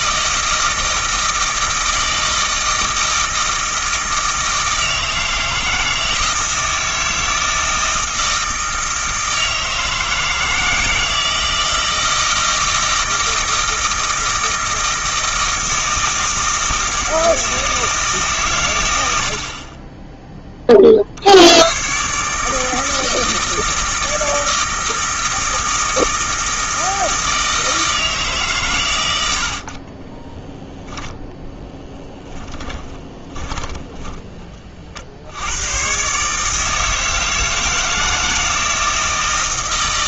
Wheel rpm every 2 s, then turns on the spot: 160, 160, 160, 160, 160, 160, 160, 160, 160, 110, 40, 160, 160, 160, 120, 10, 10, 40, 160, 160.
32-34